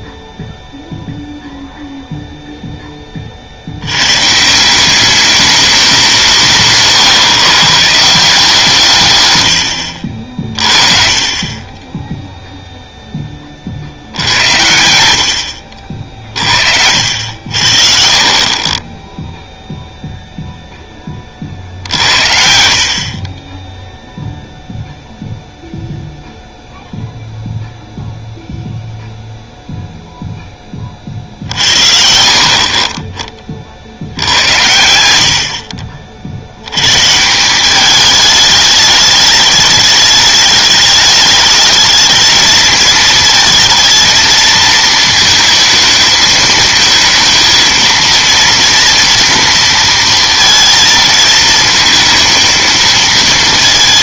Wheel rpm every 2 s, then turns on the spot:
0, 10, 170, 150, 160, 30, 0, 90, 50, 30, 0, 50, 0, 0, 0, 20, 40, 90, 90, 210, 210, 220, 220, 220, 230, 230, 230.
14-16 34-36